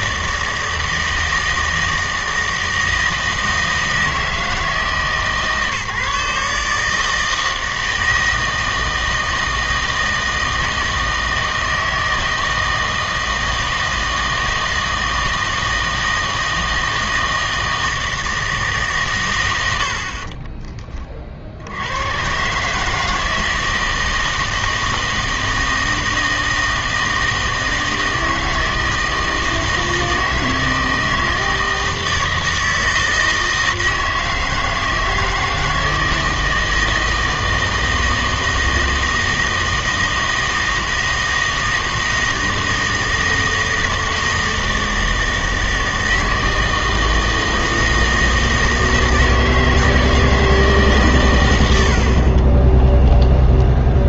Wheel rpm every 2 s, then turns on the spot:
160, 160, 160, 150, 160, 160, 160, 160, 160, 150, 20, 150, 160, 160, 160, 160, 160, 160, 160, 160, 160, 160, 160, 160, 160, 150, 20.
52-54